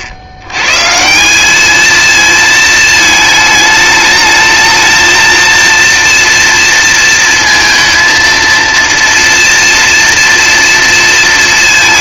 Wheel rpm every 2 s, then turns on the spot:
100, 230, 220, 230, 230, 230.
none